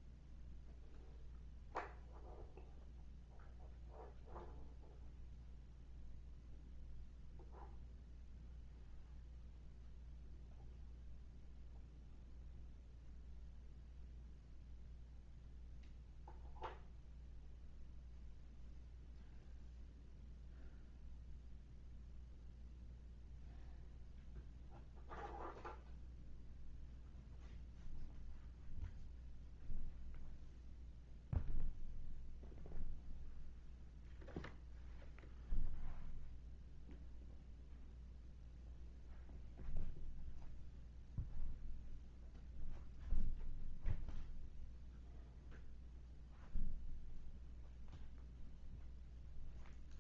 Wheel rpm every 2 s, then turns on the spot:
0, 0, 0, 0, 0, 0, 0, 0, 0, 0, 0, 0, 0, 0, 0, 0, 0, 0, 0, 0, 0, 0, 0, 0, 0.
none